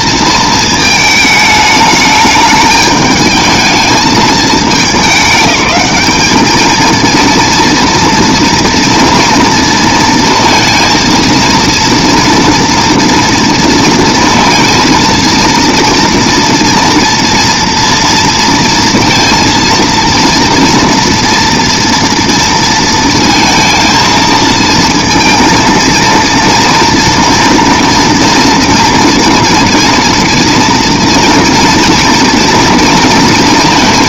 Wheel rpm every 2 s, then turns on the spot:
220, 210, 220, 220, 230, 230, 240, 230, 230, 230, 230, 230, 230, 230, 230, 230, 230.
none